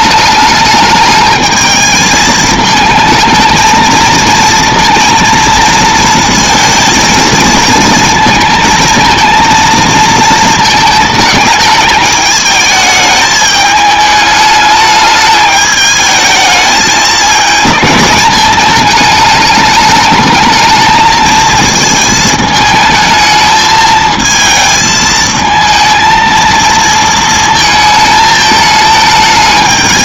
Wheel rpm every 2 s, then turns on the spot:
210, 220, 230, 230, 230, 220, 220, 210, 220, 220, 220, 220, 220, 220, 210.
none